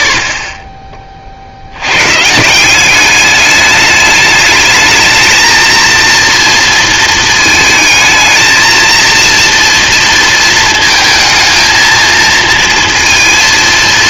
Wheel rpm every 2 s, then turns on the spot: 30, 170, 210, 230, 220, 230, 230.
none